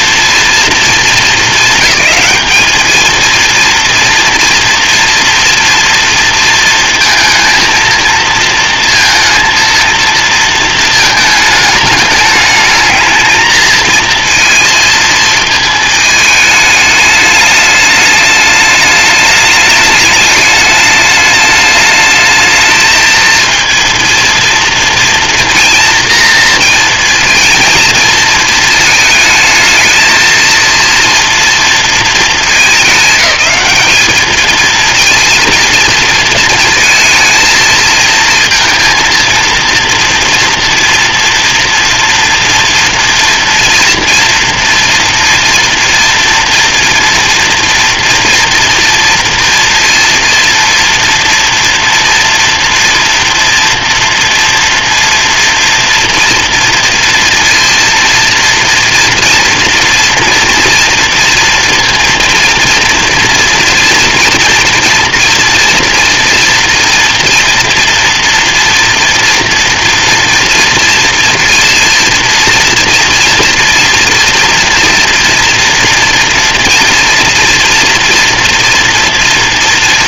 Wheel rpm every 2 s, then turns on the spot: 200, 230, 230, 230, 230, 220, 220, 220, 210, 220, 210, 230, 230, 220, 220, 230, 210, 230, 220, 230, 230, 230, 230, 230, 230, 230, 240, 230, 230, 230, 230, 230, 240, 230, 230, 230, 230, 230, 230, 230.
none